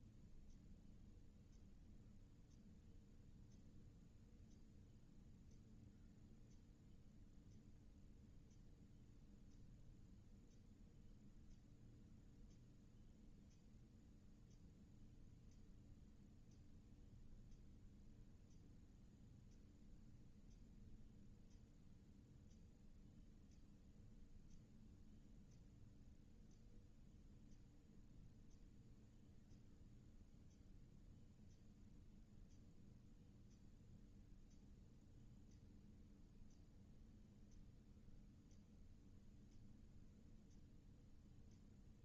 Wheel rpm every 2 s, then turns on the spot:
0, 0, 0, 0, 0, 0, 0, 0, 0, 0, 0, 0, 0, 0, 0, 0, 0, 0, 0, 0, 0.
none